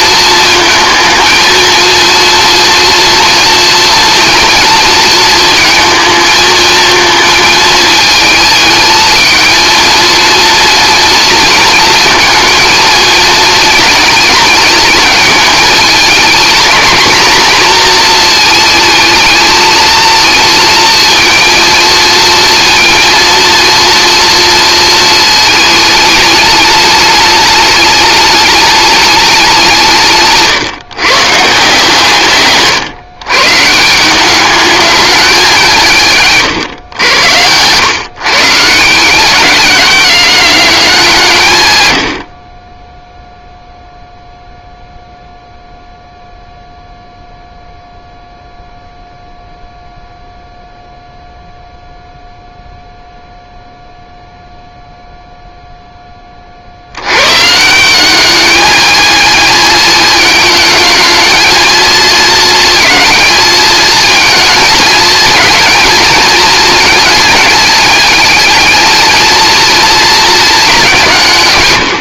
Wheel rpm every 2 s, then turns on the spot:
230, 240, 230, 220, 220, 230, 230, 220, 220, 230, 230, 230, 230, 210, 210, 140, 140, 210, 130, 150, 200, 40, 0, 0, 0, 0, 0, 0, 50, 210, 220, 230, 220, 220, 220, 210.
none